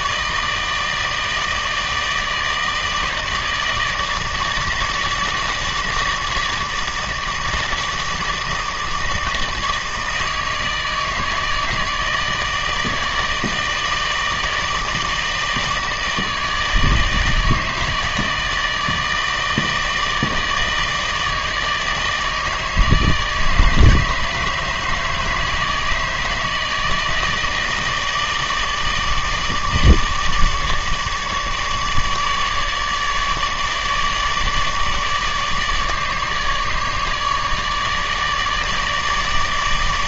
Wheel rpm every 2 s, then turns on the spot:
160, 160, 160, 160, 160, 160, 160, 160, 160, 160, 160, 160, 150, 160, 150, 150, 150, 150, 150, 150.
none